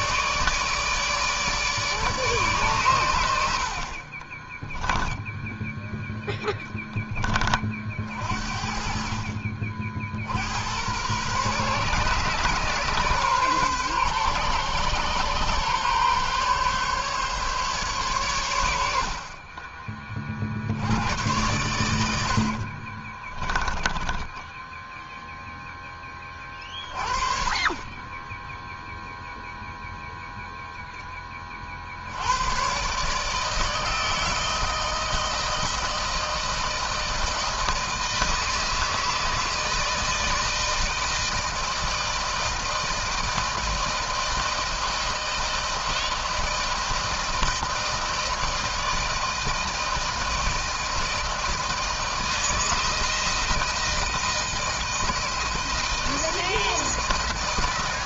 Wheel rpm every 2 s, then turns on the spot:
150, 140, 20, 10, 50, 70, 130, 130, 140, 110, 40, 70, 10, 20, 20, 0, 100, 160, 160, 160, 160, 160, 160, 160, 160, 160, 160, 160, 160.
4-6 24-26